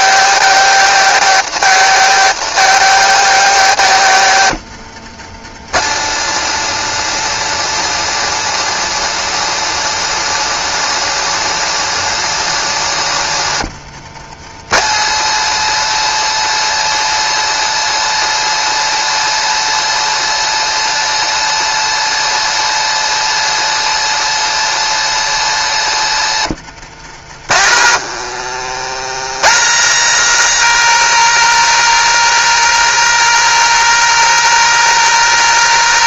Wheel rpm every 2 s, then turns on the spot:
230, 220, 170, 240, 240, 240, 190, 220, 240, 240, 240, 240, 230, 140, 130, 220, 220, 220.
26-28